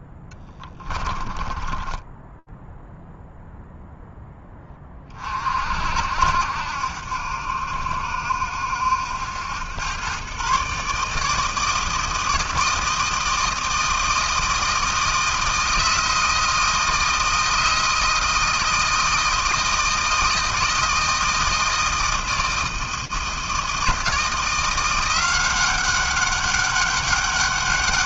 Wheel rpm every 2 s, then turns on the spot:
10, 10, 10, 60, 70, 130, 160, 160, 160, 160, 160, 160, 170, 200.
0-4